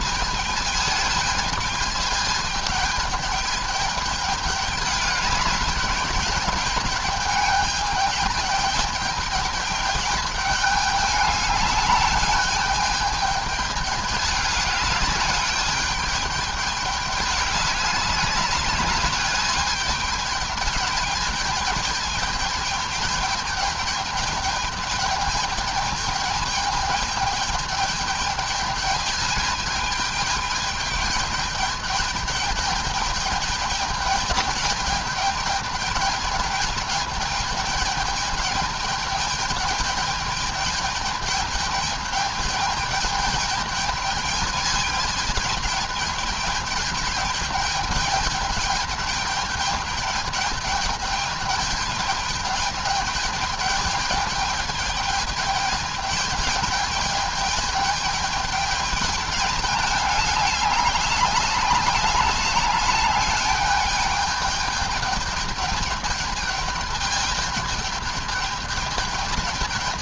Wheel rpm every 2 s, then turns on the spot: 210, 210, 210, 210, 210, 210, 210, 210, 210, 200, 210, 210, 210, 210, 210, 210, 210, 210, 210, 210, 210, 210, 210, 210, 210, 210, 210, 210, 210, 210, 200, 210, 210, 210, 210.
none